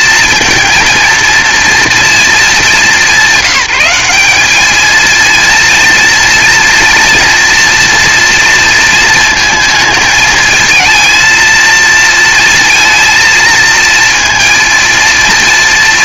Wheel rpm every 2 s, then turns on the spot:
230, 210, 220, 230, 230, 220, 230, 230.
none